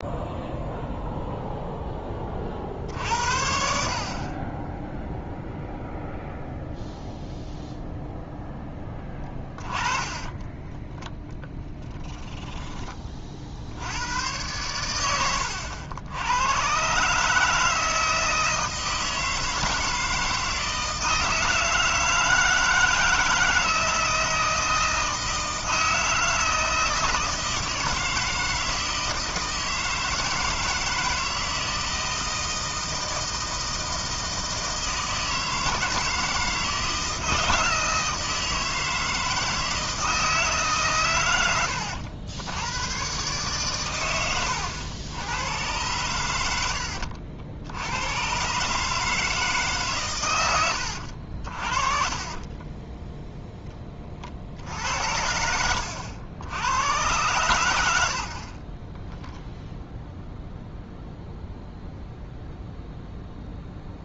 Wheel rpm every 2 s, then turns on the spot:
0, 30, 0, 0, 10, 10, 20, 100, 120, 160, 160, 160, 160, 160, 160, 160, 160, 160, 160, 160, 140, 100, 90, 80, 140, 100, 20, 80, 100, 50, 0, 0.
8-10 52-54 58-60